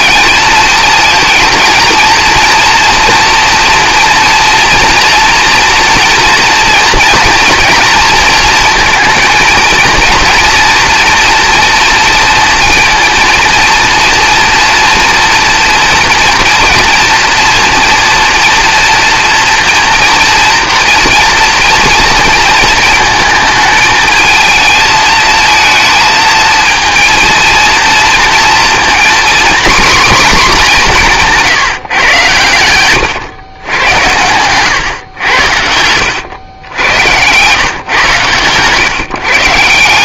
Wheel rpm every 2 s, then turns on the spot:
220, 240, 230, 230, 230, 230, 230, 230, 230, 230, 240, 220, 220, 230, 240, 230, 120, 120, 90, 140.
none